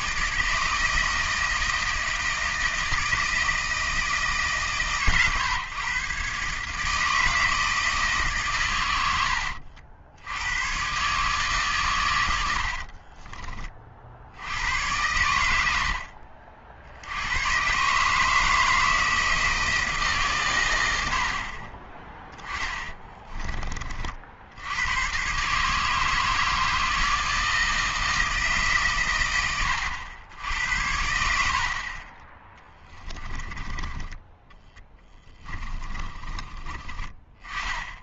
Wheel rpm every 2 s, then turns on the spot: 160, 160, 130, 150, 130, 120, 50, 90, 60, 160, 100, 20, 90, 160, 140, 80, 10, 10, 30.
12-14 22-24 32-36